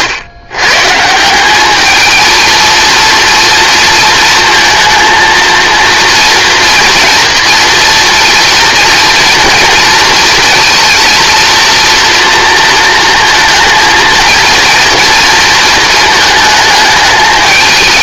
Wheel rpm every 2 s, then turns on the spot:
140, 230, 230, 230, 240, 230, 220, 230, 210.
none